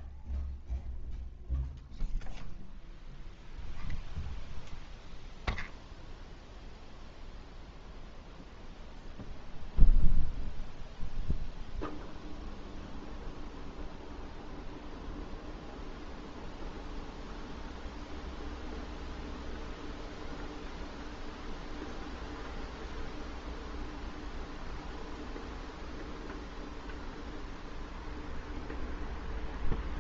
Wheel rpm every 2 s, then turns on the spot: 0, 0, 0, 0, 0, 0, 0, 0, 0, 0, 0, 0, 0, 0, 0.
none